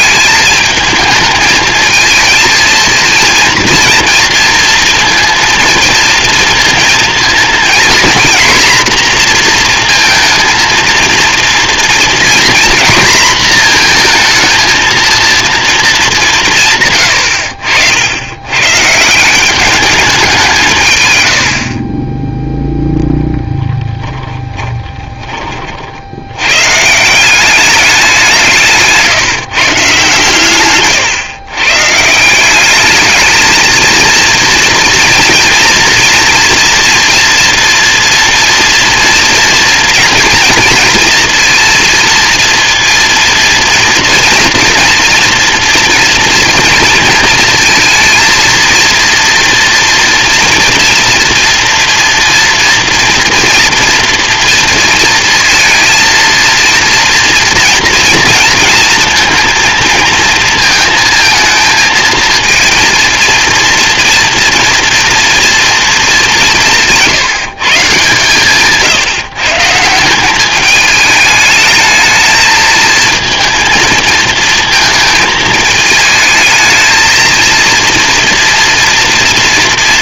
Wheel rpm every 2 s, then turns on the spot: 210, 230, 230, 230, 240, 230, 240, 230, 150, 120, 150, 0, 20, 140, 170, 130, 200, 230, 230, 230, 230, 230, 230, 230, 230, 230, 230, 230, 230, 230, 230, 230, 230, 180, 140, 210, 220, 220, 220, 230.
24-26 30-32